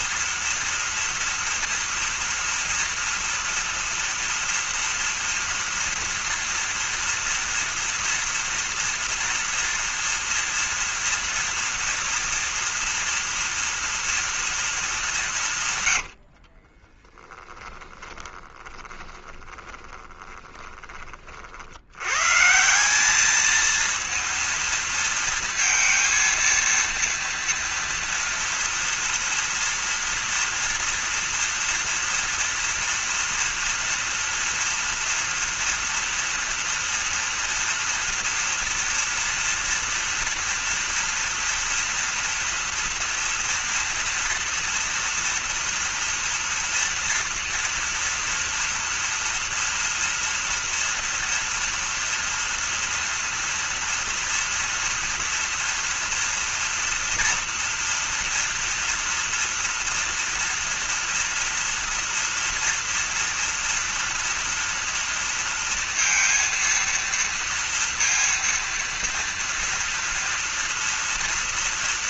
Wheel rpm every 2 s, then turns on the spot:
240, 240, 230, 230, 240, 230, 230, 220, 40, 20, 20, 170, 230, 230, 230, 230, 230, 230, 230, 230, 240, 230, 230, 230, 240, 230, 230, 230, 230, 240, 230, 240, 230, 230, 230, 230.
16-22